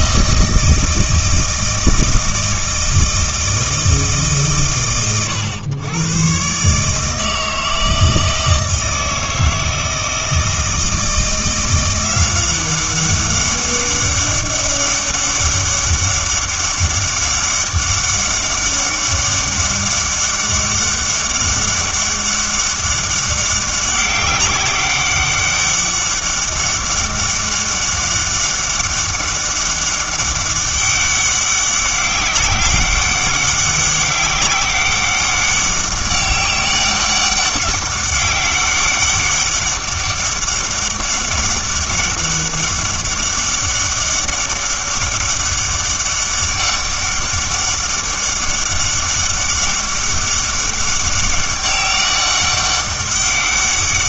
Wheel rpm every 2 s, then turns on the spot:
160, 160, 90, 140, 160, 160, 190, 200, 200, 200, 200, 200, 200, 200, 200, 200, 190, 200, 200, 200, 200, 200, 200, 200, 200, 200, 200.
none